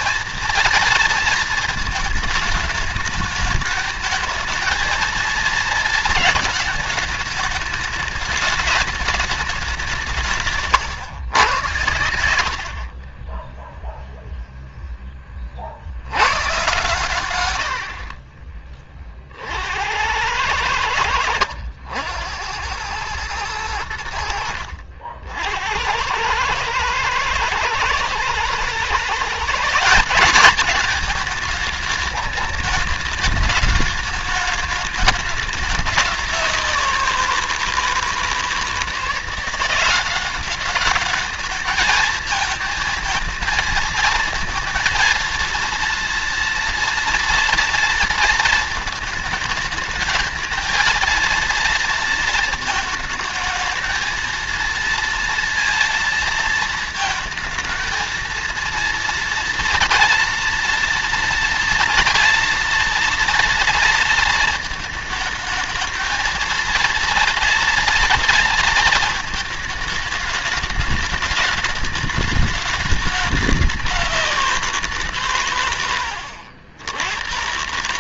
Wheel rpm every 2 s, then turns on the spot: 230, 210, 220, 220, 210, 150, 60, 0, 110, 20, 90, 90, 70, 100, 120, 200, 210, 210, 190, 160, 200, 220, 230, 230, 230, 220, 220, 230, 230, 230, 240, 230, 220, 230, 230, 210, 210, 180, 80.
10-14